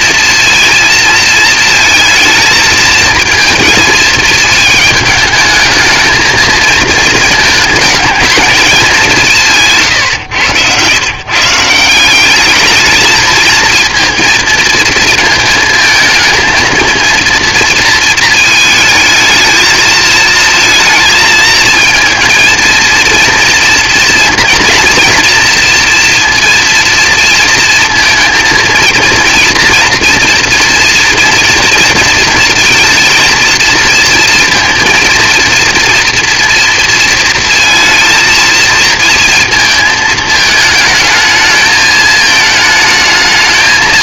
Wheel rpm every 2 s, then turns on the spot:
230, 220, 220, 220, 210, 120, 210, 220, 230, 220, 220, 230, 230, 230, 230, 230, 230, 230, 230, 230, 220, 220.
none